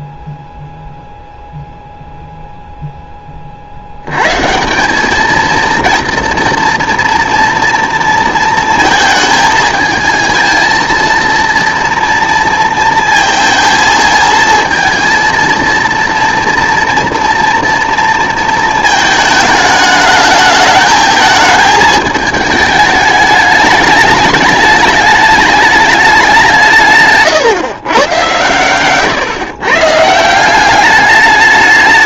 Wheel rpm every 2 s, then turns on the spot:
0, 0, 150, 230, 220, 230, 230, 220, 230, 220, 220, 220, 210, 170, 120, 190.
none